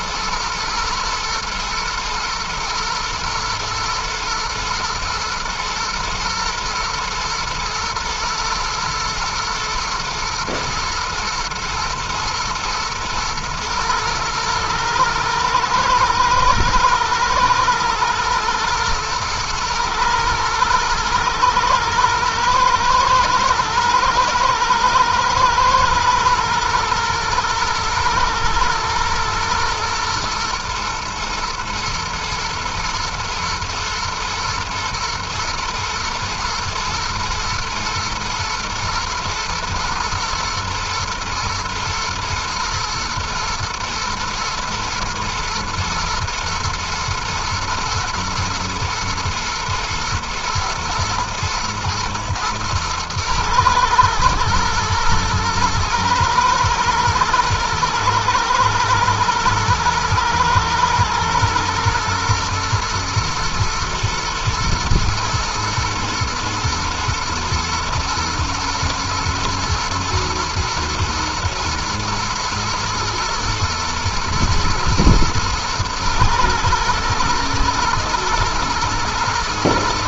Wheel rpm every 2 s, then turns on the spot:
110, 110, 110, 120, 110, 120, 110, 110, 110, 110, 120, 110, 120, 120, 120, 110, 110, 110, 110, 110, 110, 110, 110, 110, 120, 110, 110, 110, 110, 110, 110, 120, 120, 120, 120, 110, 110, 110, 120, 120.
none